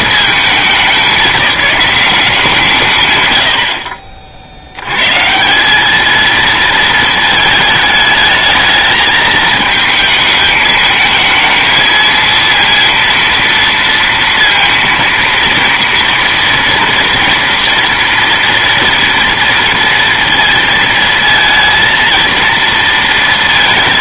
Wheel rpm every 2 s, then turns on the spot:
190, 150, 90, 230, 220, 220, 230, 230, 230, 230, 230, 230.
none